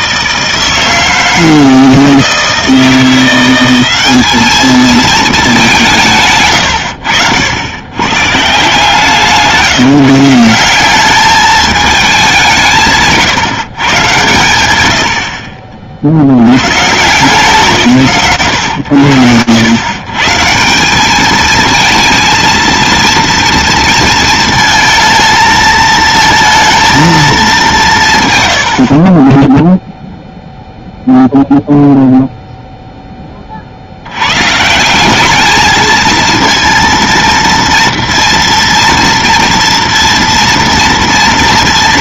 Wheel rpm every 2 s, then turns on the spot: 160, 160, 220, 120, 140, 180, 190, 100, 60, 100, 190, 230, 230, 230, 40, 0, 0, 140, 230, 230, 230.
none